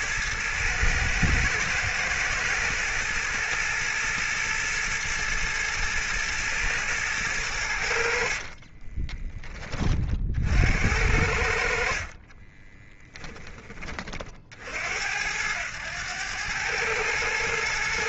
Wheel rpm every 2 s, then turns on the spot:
110, 110, 110, 110, 20, 70, 10, 80, 110.
8-10